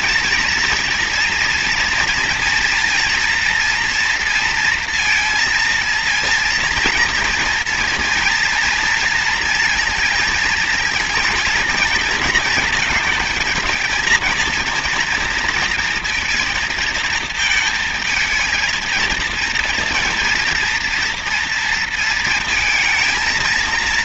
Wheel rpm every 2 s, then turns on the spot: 230, 230, 230, 230, 230, 230, 220, 230, 220, 220, 230, 230.
none